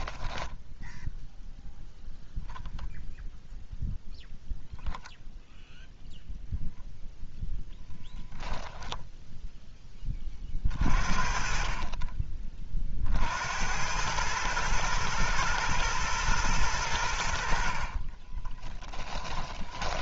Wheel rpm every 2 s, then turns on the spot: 0, 10, 0, 0, 10, 40, 40, 110, 100, 10.
18-20